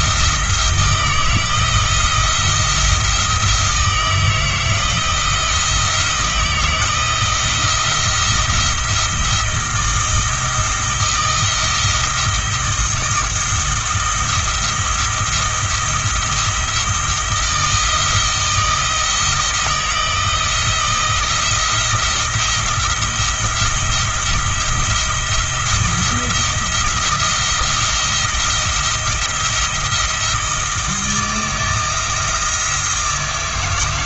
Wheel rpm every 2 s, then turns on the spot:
160, 170, 160, 160, 170, 160, 160, 170, 170, 160, 170, 170, 170, 170, 170, 160, 160.
none